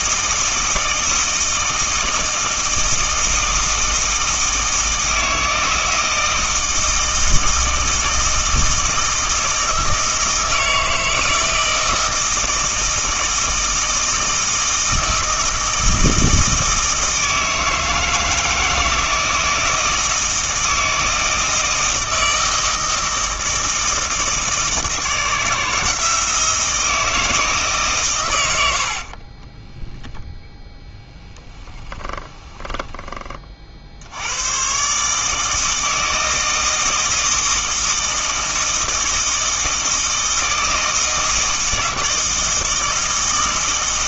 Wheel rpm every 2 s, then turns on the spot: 160, 160, 160, 160, 160, 160, 160, 160, 160, 160, 160, 160, 160, 160, 80, 10, 20, 130, 160, 160, 160, 160.
28-34